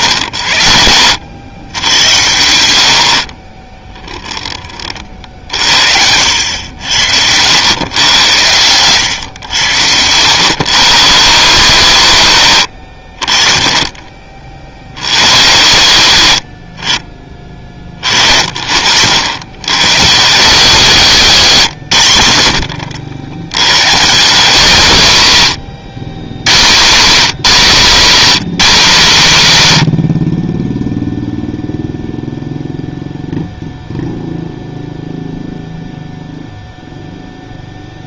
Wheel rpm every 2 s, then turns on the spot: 80, 80, 30, 80, 110, 120, 80, 50, 60, 50, 200, 70, 190, 150, 210, 20, 0, 0, 0.
none